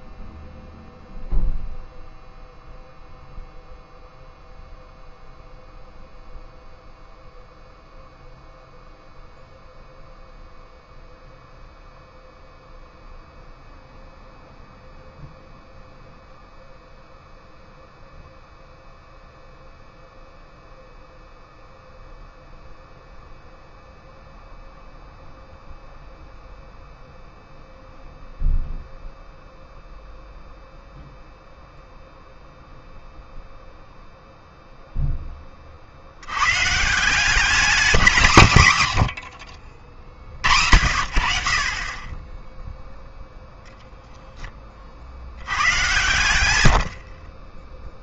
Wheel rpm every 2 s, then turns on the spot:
0, 0, 0, 0, 0, 0, 0, 0, 0, 0, 0, 0, 0, 0, 0, 0, 0, 0, 140, 140, 90, 10, 20, 80.
none